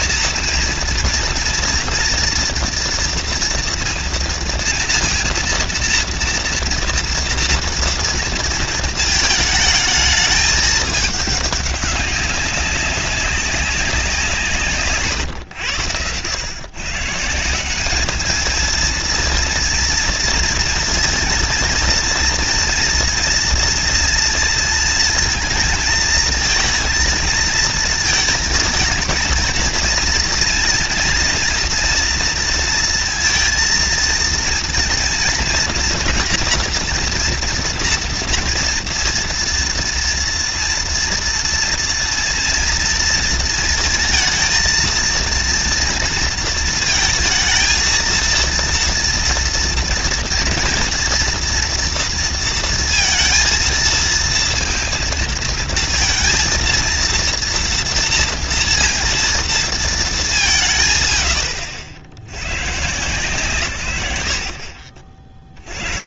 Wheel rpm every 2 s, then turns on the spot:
230, 230, 230, 230, 230, 210, 190, 170, 110, 220, 230, 230, 230, 220, 230, 230, 230, 230, 230, 230, 230, 230, 230, 230, 230, 240, 230, 230, 230, 230, 170, 100, 100.
none